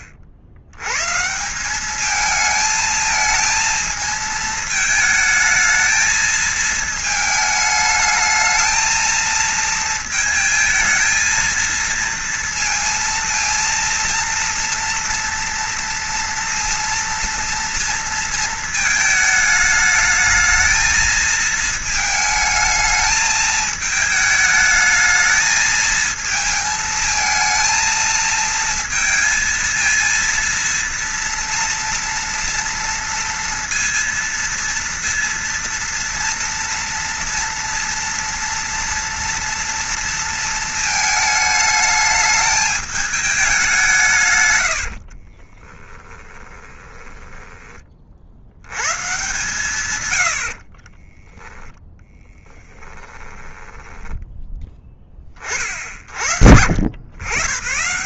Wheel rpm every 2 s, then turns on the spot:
80, 220, 220, 220, 230, 220, 230, 230, 230, 220, 220, 220, 220, 220, 230, 230, 230, 230, 240, 240, 220, 210, 60, 20, 130, 30, 20, 10, 80.
44-48 50-54